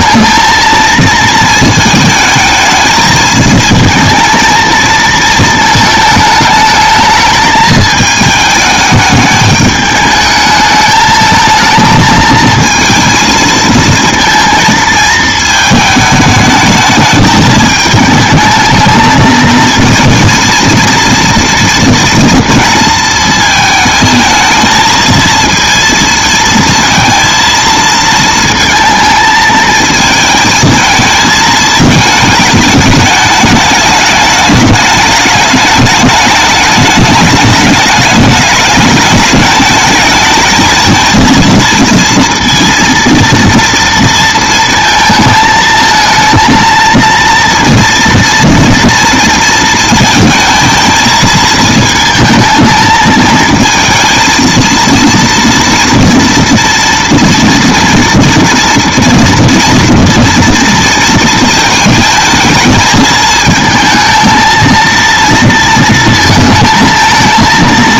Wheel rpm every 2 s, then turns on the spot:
230, 220, 220, 220, 220, 210, 220, 220, 210, 220, 230, 230, 230, 230, 220, 220, 210, 210, 210, 210, 220, 230, 230, 230, 230, 230, 220, 230, 230, 230, 230, 220, 230, 230.
none